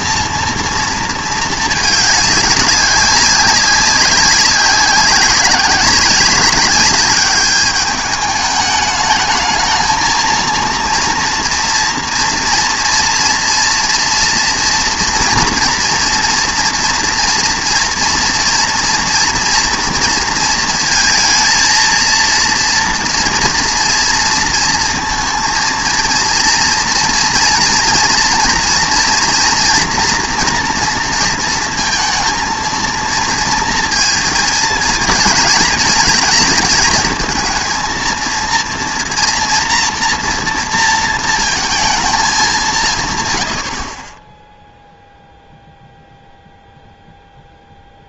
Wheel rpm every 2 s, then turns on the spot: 230, 200, 190, 200, 210, 230, 230, 230, 240, 230, 230, 230, 230, 230, 230, 230, 230, 220, 220, 230, 230, 170, 0, 0.
none